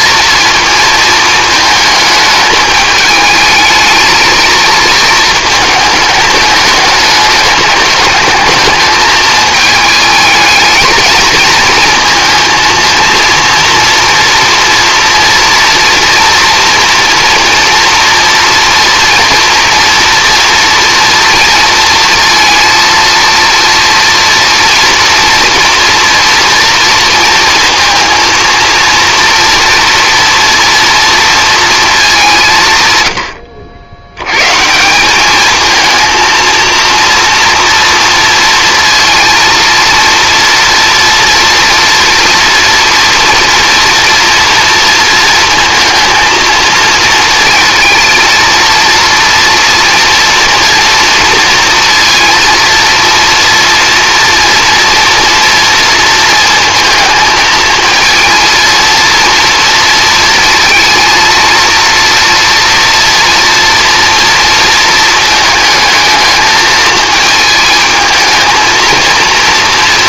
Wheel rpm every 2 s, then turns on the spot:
230, 210, 220, 210, 220, 220, 230, 240, 240, 240, 230, 230, 230, 230, 230, 230, 130, 170, 230, 230, 240, 240, 230, 230, 230, 230, 230, 230, 230, 230, 230, 240, 230, 220, 220.
none